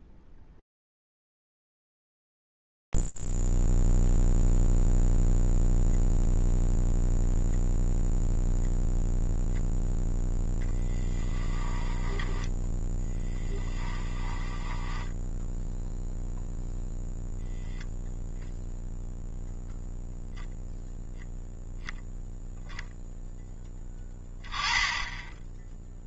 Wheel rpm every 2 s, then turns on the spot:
0, 0, 0, 0, 0, 0, 20, 10, 0, 0, 0, 0, 10.
12-16